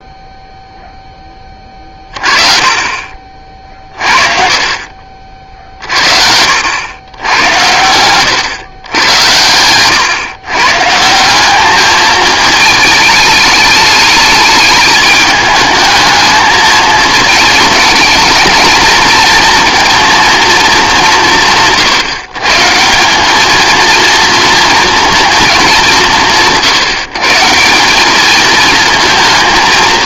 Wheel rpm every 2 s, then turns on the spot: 0, 30, 40, 90, 110, 150, 220, 210, 220, 220, 180, 160, 230, 140, 220.
none